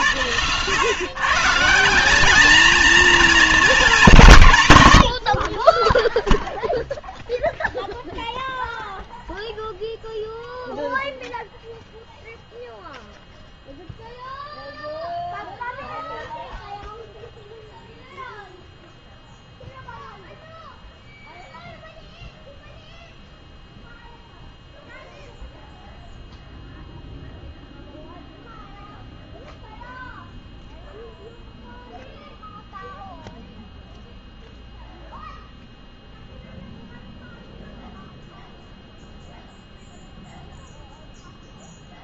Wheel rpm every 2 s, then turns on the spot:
110, 210, 150, 0, 0, 0, 0, 0, 0, 0, 0, 0, 0, 0, 0, 0, 0, 0, 0, 0, 0.
none